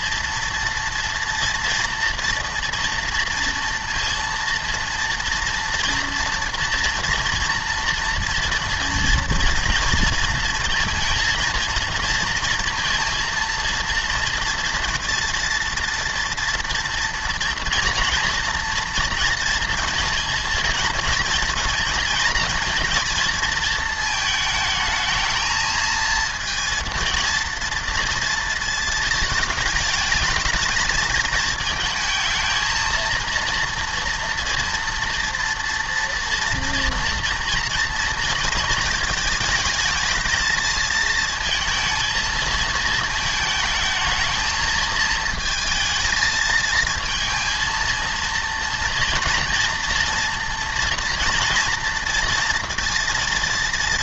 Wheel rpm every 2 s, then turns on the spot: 230, 230, 230, 230, 230, 230, 230, 240, 230, 230, 230, 230, 220, 230, 220, 220, 230, 230, 230, 220, 220, 220, 220, 220, 230, 230, 240.
none